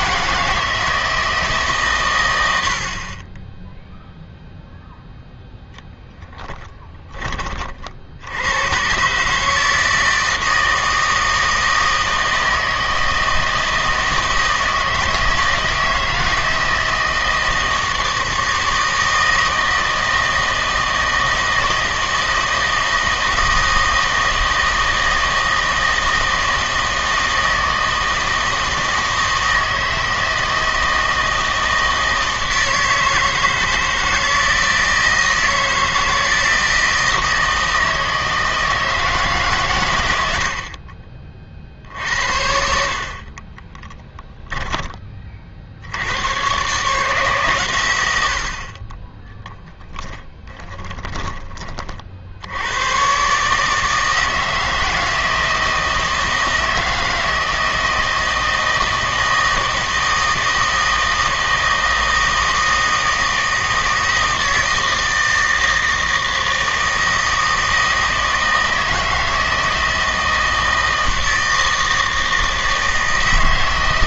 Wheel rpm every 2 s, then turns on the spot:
160, 70, 0, 10, 120, 160, 160, 160, 160, 160, 160, 160, 160, 160, 160, 160, 160, 160, 160, 160, 60, 60, 10, 130, 40, 20, 100, 160, 160, 160, 160, 160, 160, 160, 160, 160, 160.
50-52